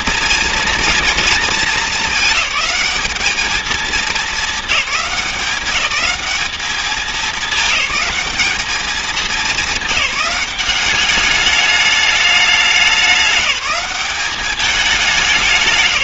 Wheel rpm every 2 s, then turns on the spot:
230, 210, 210, 210, 210, 190, 200, 200.
none